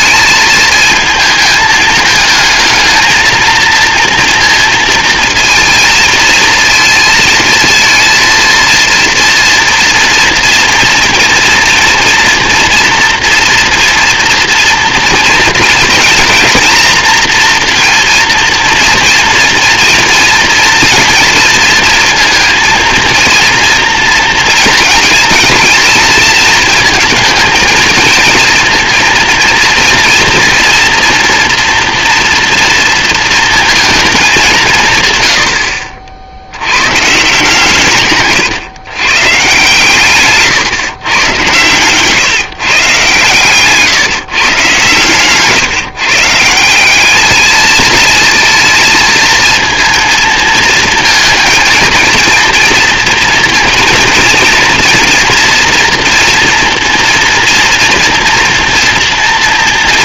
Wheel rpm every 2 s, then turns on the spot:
220, 220, 230, 230, 230, 230, 240, 230, 230, 230, 230, 230, 230, 220, 230, 230, 230, 170, 110, 120, 130, 140, 130, 170, 220, 220, 230, 230, 240, 230.
none